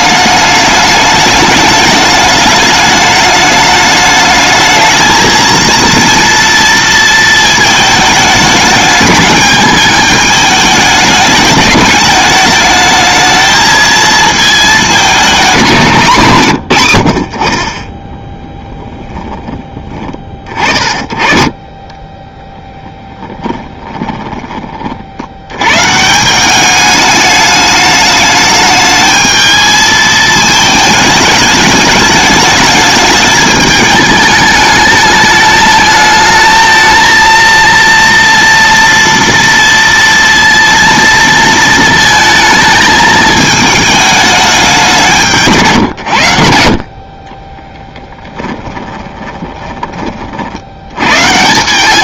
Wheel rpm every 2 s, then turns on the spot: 210, 210, 220, 230, 210, 210, 220, 220, 130, 10, 30, 10, 40, 200, 210, 220, 210, 210, 220, 230, 230, 220, 200, 60, 20, 80.
22-24 48-50